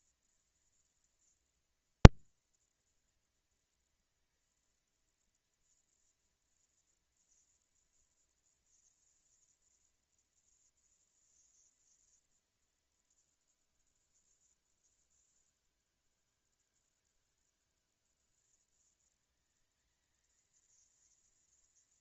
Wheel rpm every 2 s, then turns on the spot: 230, 230, 230, 230, 230, 230, 220, 170, 160, 190, 220.
none